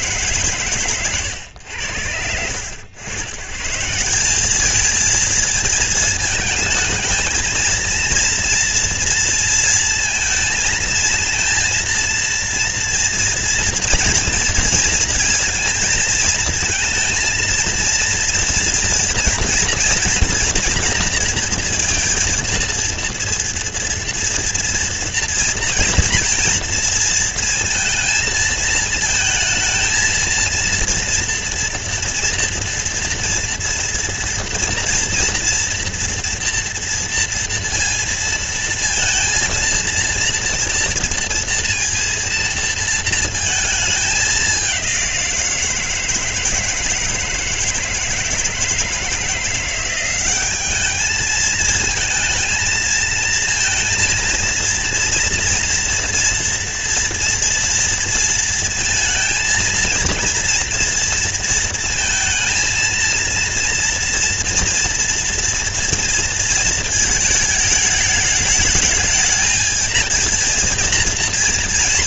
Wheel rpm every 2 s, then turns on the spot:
150, 80, 170, 220, 230, 230, 230, 230, 220, 230, 230, 230, 230, 230, 230, 230, 230, 230, 230, 230, 230, 230, 210, 160, 160, 190, 220, 230, 230, 230, 220, 230, 240, 230, 210, 230.
none